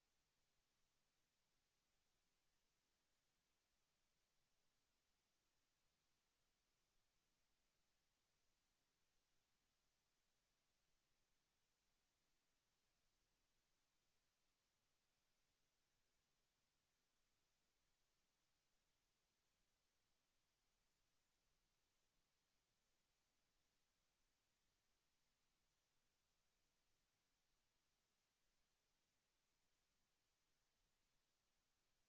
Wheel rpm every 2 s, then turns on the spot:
0, 0, 0, 0, 0, 0, 0, 0, 0, 0, 0, 0, 0, 0, 0, 0.
none